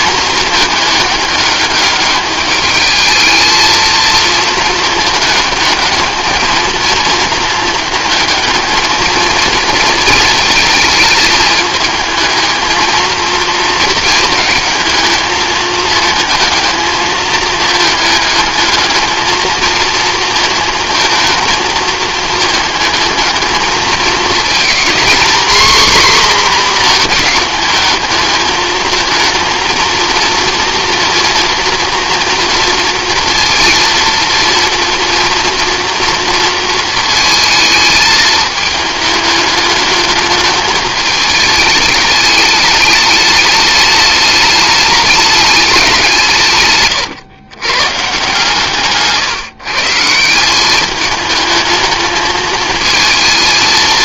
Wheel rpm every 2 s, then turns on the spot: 210, 210, 220, 220, 220, 220, 220, 220, 220, 210, 220, 220, 230, 250, 220, 230, 230, 230, 230, 220, 220, 210, 210, 140, 150, 200, 220.
none